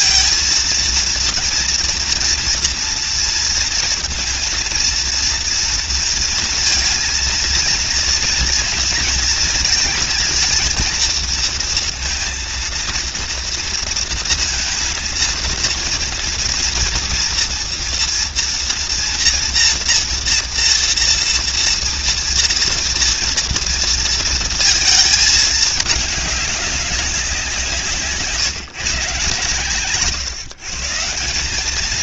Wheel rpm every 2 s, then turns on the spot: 230, 230, 230, 230, 240, 230, 230, 230, 240, 230, 230, 230, 230, 210, 150, 130.
none